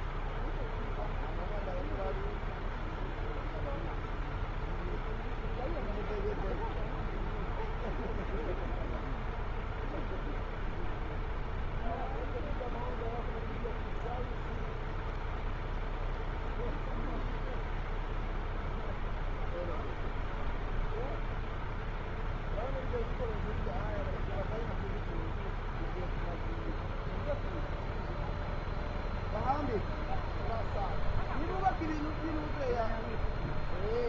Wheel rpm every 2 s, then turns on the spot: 0, 0, 0, 0, 0, 0, 0, 0, 0, 0, 0, 0, 0, 0, 0, 0, 0.
none